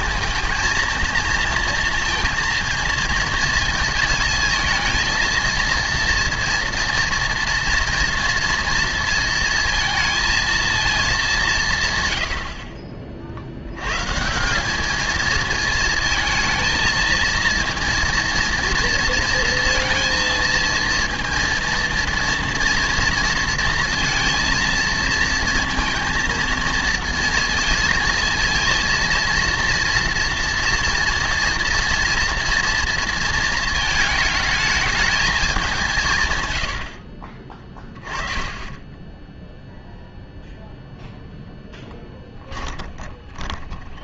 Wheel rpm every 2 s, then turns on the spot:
230, 230, 230, 230, 230, 220, 60, 200, 230, 230, 230, 230, 230, 230, 220, 230, 230, 220, 90, 20, 0, 20.
42-44